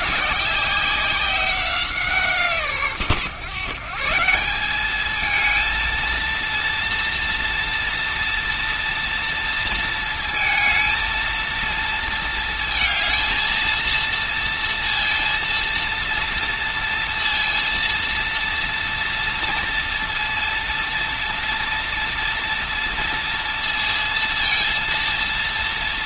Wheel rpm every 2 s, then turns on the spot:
180, 140, 210, 230, 230, 220, 220, 230, 230, 230, 230, 230, 230.
none